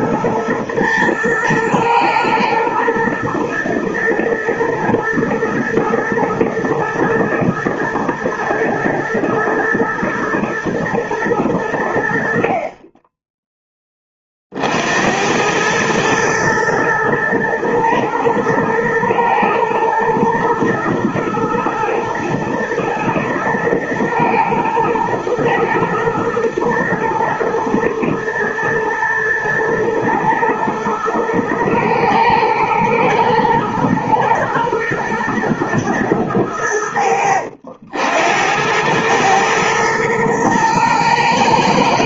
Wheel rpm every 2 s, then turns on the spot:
110, 110, 120, 110, 110, 120, 40, 60, 110, 110, 120, 110, 110, 120, 110, 120, 110, 120, 90, 100, 110.
none